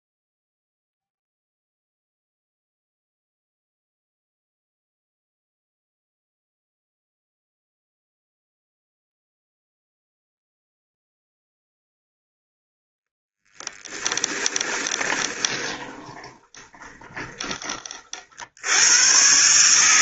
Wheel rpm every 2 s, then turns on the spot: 0, 0, 0, 0, 0, 0, 0, 20, 20, 90.
14-18